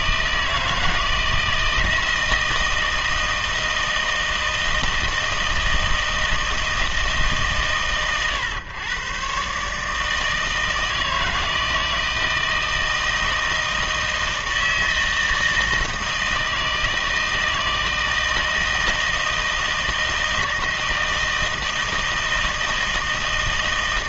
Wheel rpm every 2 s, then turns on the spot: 160, 160, 160, 160, 120, 160, 160, 160, 160, 160, 160, 160.
none